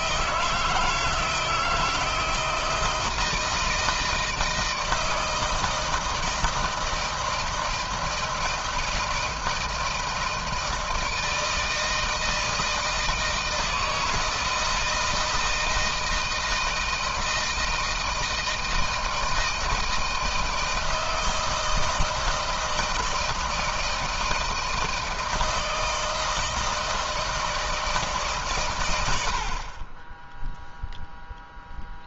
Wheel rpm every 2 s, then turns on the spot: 160, 160, 160, 160, 160, 160, 160, 160, 160, 160, 160, 160, 160, 160, 120, 0.
none